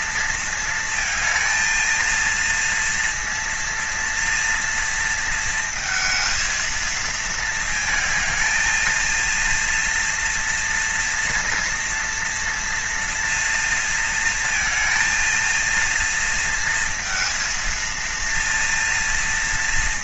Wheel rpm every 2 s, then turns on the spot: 230, 230, 230, 230, 220, 230, 240, 230, 230, 230.
none